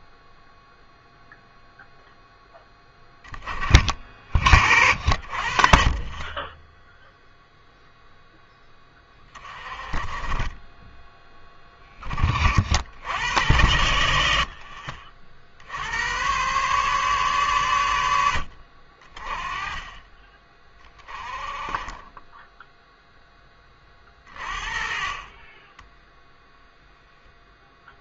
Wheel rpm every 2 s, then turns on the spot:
0, 10, 60, 10, 10, 10, 60, 50, 140, 50, 20, 0, 40, 0.
none